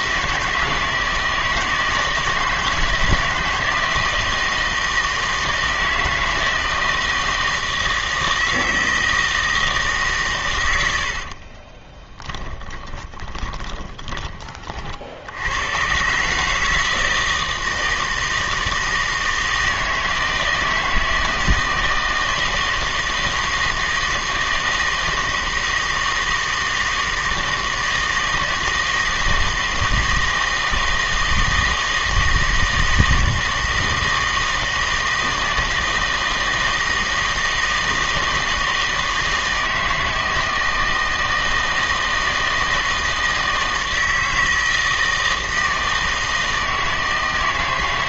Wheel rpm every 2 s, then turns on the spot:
160, 160, 160, 160, 160, 90, 20, 50, 150, 160, 160, 160, 160, 160, 160, 160, 160, 160, 160, 160, 160, 160, 160, 160.
12-14